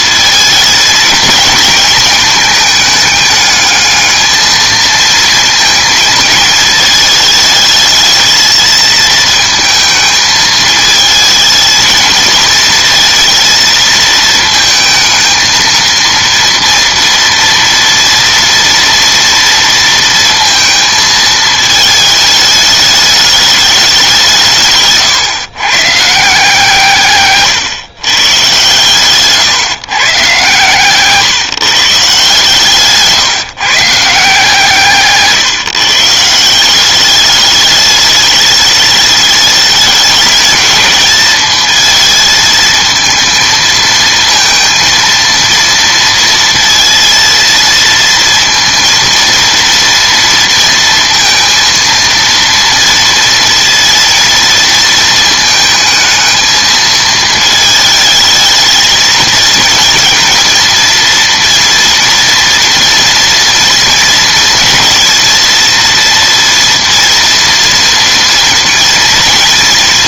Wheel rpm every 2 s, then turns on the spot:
220, 220, 220, 220, 220, 220, 230, 220, 230, 230, 230, 210, 160, 160, 130, 130, 140, 160, 180, 210, 220, 220, 230, 230, 230, 230, 230, 230, 220, 220, 230, 230, 230, 230, 230.
none